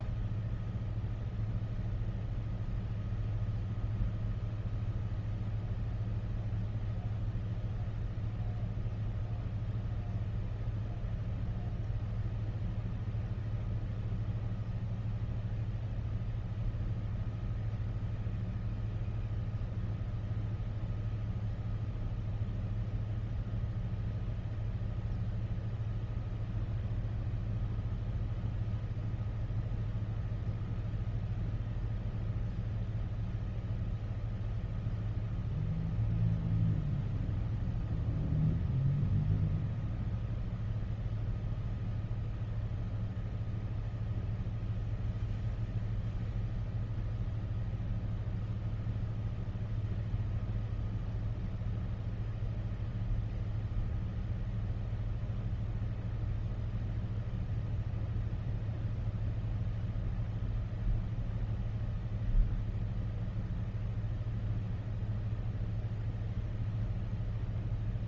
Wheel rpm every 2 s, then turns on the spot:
0, 0, 0, 0, 0, 0, 0, 0, 0, 0, 0, 0, 0, 0, 0, 0, 0, 0, 0, 0, 0, 0, 0, 0, 0, 0, 0, 0, 0, 0, 0, 0, 0, 0.
none